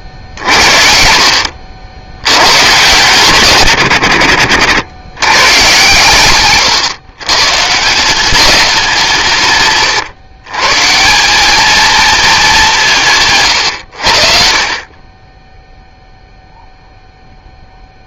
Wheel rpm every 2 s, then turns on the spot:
60, 100, 80, 130, 200, 140, 210, 50, 0.
4-8